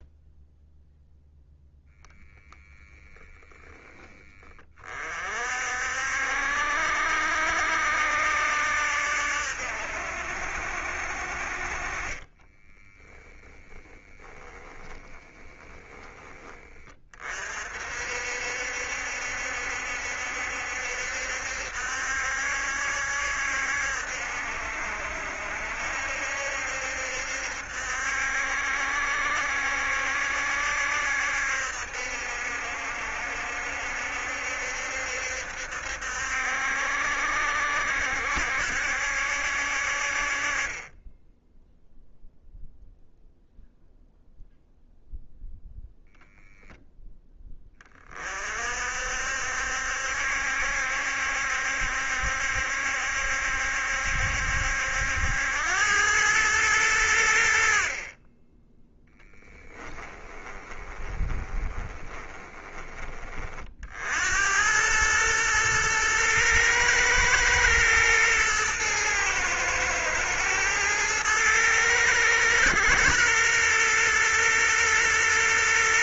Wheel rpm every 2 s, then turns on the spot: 0, 0, 30, 70, 70, 60, 20, 10, 20, 60, 70, 70, 70, 70, 70, 70, 70, 70, 70, 70, 30, 0, 0, 0, 50, 70, 70, 70, 100, 10, 20, 20, 100, 110, 110, 110, 110, 120.
12-16 60-62